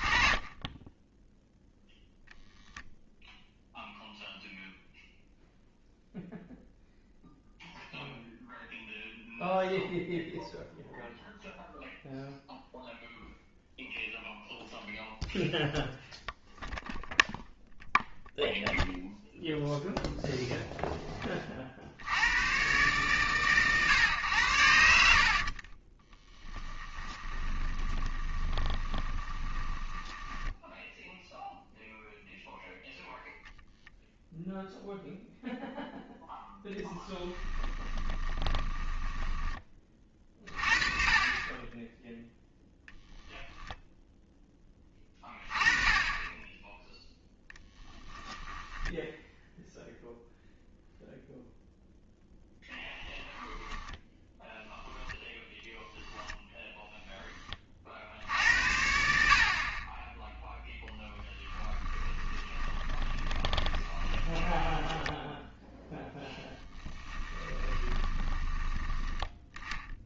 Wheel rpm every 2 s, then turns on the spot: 10, 0, 0, 0, 0, 0, 0, 0, 0, 0, 10, 120, 80, 10, 20, 10, 0, 0, 10, 10, 30, 10, 20, 10, 10, 0, 0, 0, 0, 70, 0, 20, 10, 10, 10.
0-2 24-32 36-40 48-50 62-68